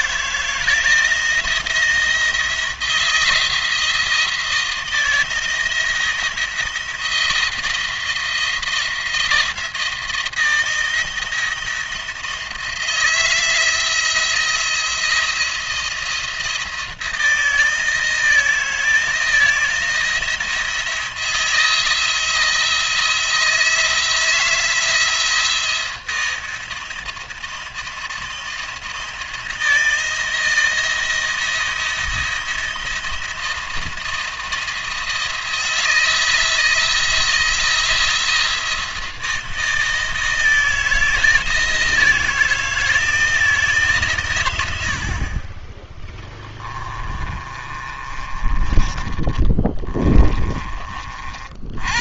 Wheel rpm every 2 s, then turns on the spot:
160, 170, 170, 170, 170, 170, 160, 170, 170, 160, 170, 170, 170, 170, 170, 170, 170, 170, 160, 170, 160, 160, 90, 20, 30, 30.
46-52